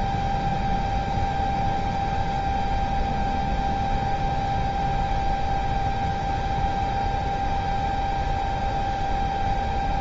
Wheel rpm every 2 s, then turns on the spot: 0, 0, 0, 0, 0.
none